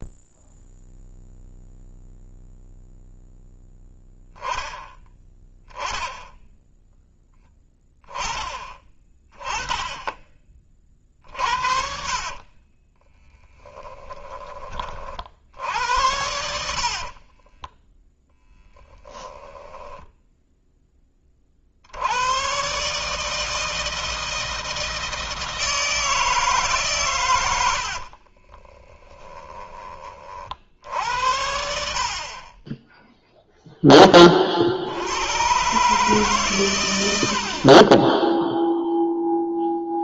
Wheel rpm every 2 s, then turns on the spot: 0, 0, 10, 10, 20, 40, 30, 50, 50, 20, 20, 150, 160, 130, 20, 70, 10, 80, 100, 0.
12-14 16-20 28-30